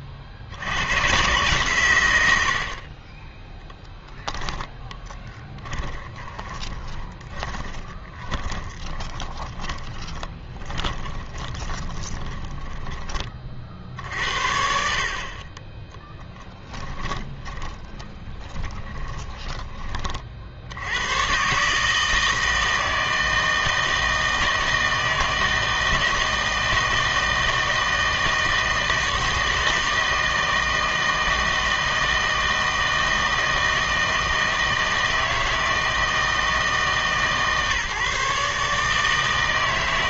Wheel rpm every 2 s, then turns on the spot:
100, 60, 10, 20, 20, 20, 10, 60, 10, 20, 80, 160, 160, 160, 160, 160, 160, 160, 160, 150.
6-14 16-20